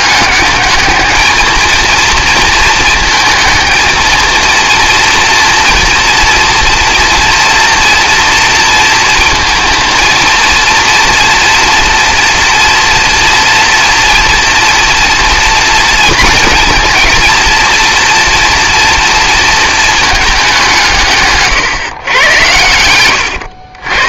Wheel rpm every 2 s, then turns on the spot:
210, 230, 230, 230, 230, 230, 230, 230, 230, 230, 180, 100.
none